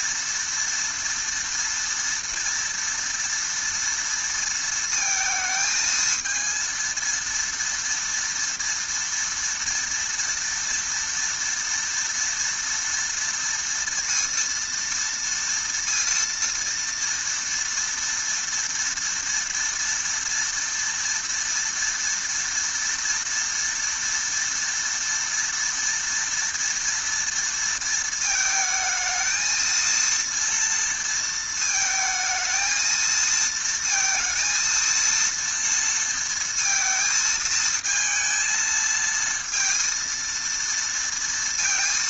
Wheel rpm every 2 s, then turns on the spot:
230, 230, 230, 230, 230, 230, 230, 230, 230, 230, 230, 230, 230, 230, 220, 230, 220, 230, 230, 220, 230.
none